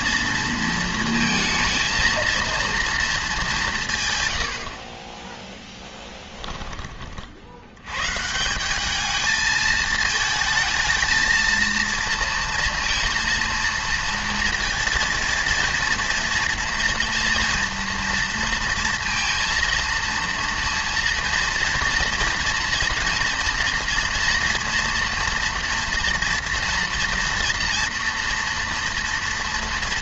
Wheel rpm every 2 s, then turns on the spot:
230, 230, 70, 20, 180, 220, 230, 230, 230, 230, 230, 230, 240, 240, 230.
none